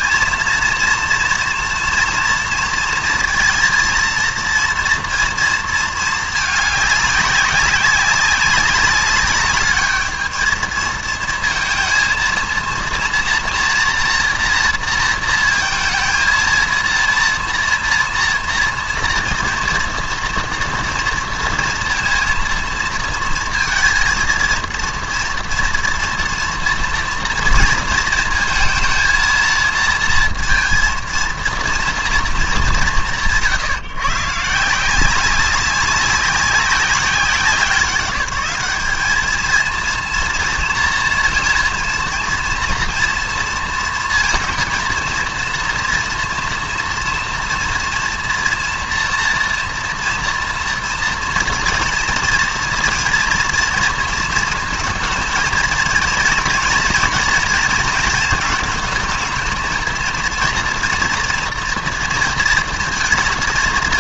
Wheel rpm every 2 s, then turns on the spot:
230, 230, 230, 210, 200, 220, 230, 230, 230, 230, 230, 230, 230, 230, 230, 230, 200, 160, 190, 200, 230, 230, 230, 230, 230, 230, 230, 230, 230, 230, 230, 230.
none